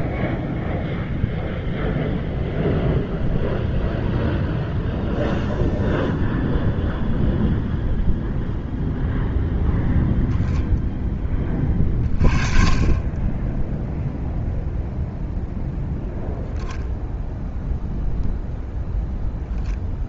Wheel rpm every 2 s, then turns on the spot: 0, 0, 0, 0, 0, 0, 20, 0, 0, 10.
none